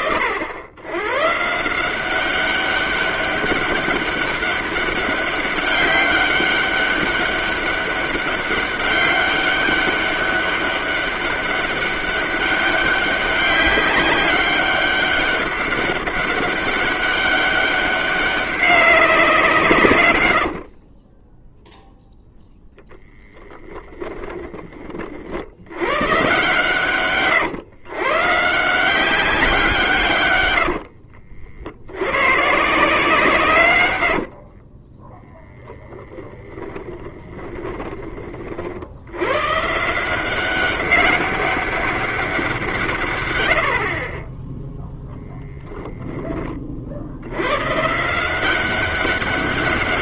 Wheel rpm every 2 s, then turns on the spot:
80, 200, 200, 200, 200, 200, 200, 200, 200, 200, 40, 0, 20, 130, 160, 80, 150, 40, 20, 40, 190, 160, 10, 40, 190.
20-22 30-32 34-38